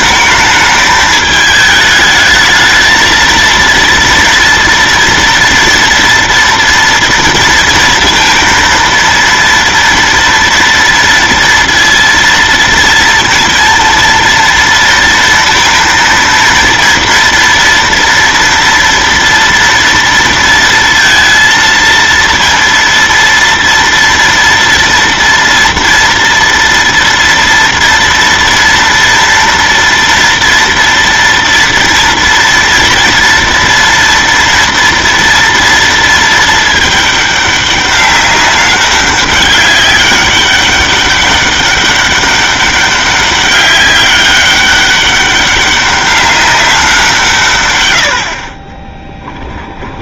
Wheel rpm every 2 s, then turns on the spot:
210, 220, 230, 240, 230, 230, 230, 230, 230, 230, 230, 230, 230, 230, 240, 230, 230, 230, 220, 200, 200, 200, 200, 200, 40.
none